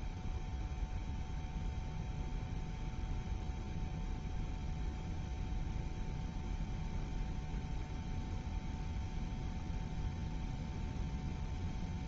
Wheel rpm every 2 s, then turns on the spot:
0, 0, 0, 0, 0, 0.
none